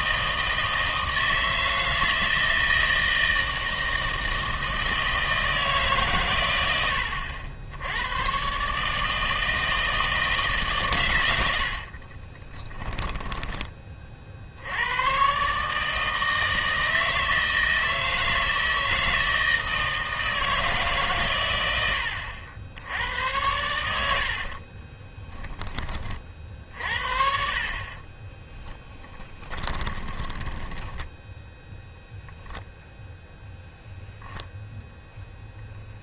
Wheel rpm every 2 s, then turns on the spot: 160, 160, 160, 80, 150, 140, 10, 90, 160, 160, 150, 90, 30, 60, 10, 10, 0, 0.
12-14 24-26 28-32